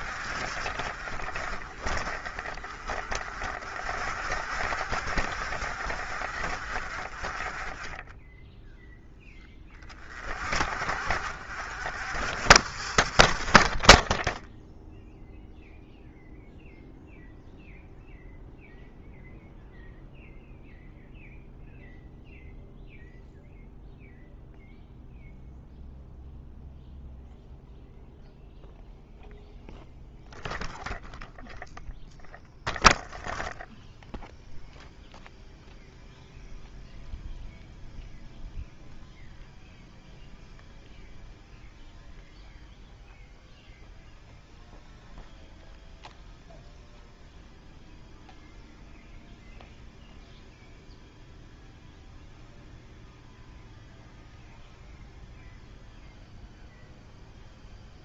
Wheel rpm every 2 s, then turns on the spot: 50, 40, 60, 50, 10, 40, 50, 0, 0, 0, 0, 0, 0, 0, 0, 0, 0, 0, 0, 0, 0, 0, 0, 0, 0, 0, 0, 0, 0.
none